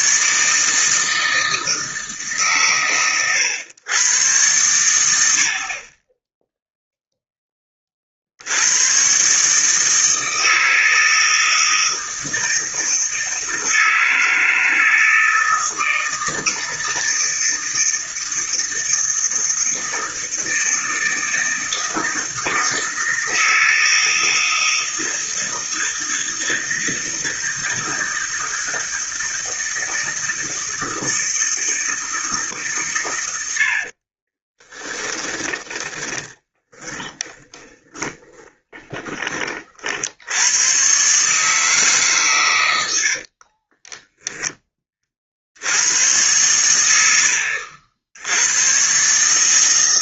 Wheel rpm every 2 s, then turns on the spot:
160, 130, 110, 0, 90, 160, 160, 160, 160, 160, 160, 160, 160, 160, 160, 160, 140, 20, 20, 20, 110, 110, 20, 100, 120.
34-40